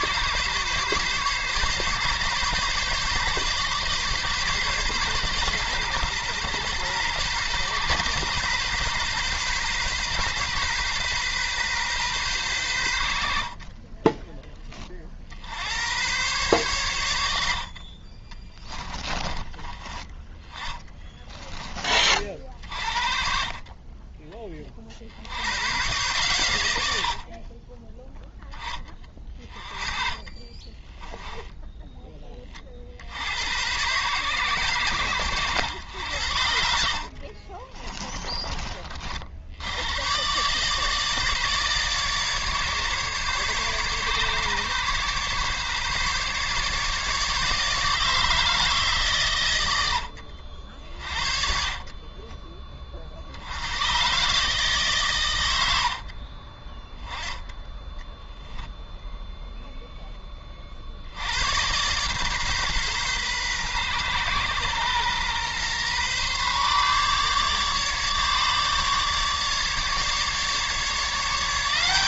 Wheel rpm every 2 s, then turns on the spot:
140, 140, 130, 120, 130, 130, 100, 30, 100, 20, 20, 50, 40, 80, 20, 20, 50, 110, 50, 40, 150, 140, 140, 150, 140, 60, 40, 130, 10, 0, 60, 130, 120, 140, 150, 160.
18-22 28-32 36-38 50-52